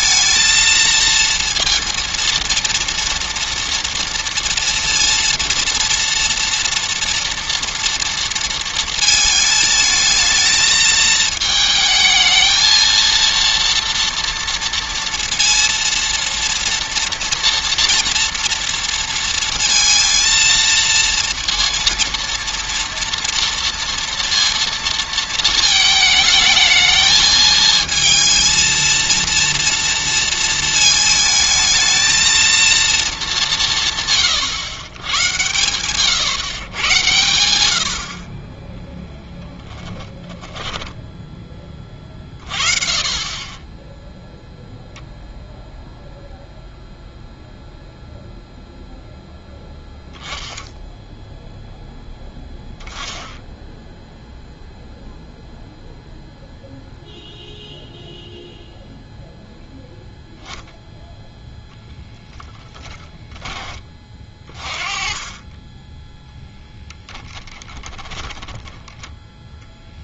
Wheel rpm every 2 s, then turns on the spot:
230, 230, 230, 230, 220, 220, 230, 230, 230, 230, 230, 230, 230, 220, 230, 220, 230, 110, 110, 10, 10, 30, 0, 0, 0, 0, 0, 0, 0, 0, 0, 10, 20, 0, 10.
40-42 62-64 68-70